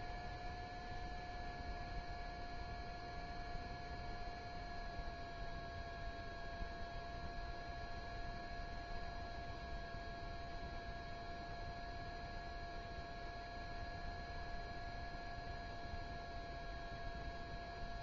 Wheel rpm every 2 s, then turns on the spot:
0, 0, 0, 0, 0, 0, 0, 0, 0.
none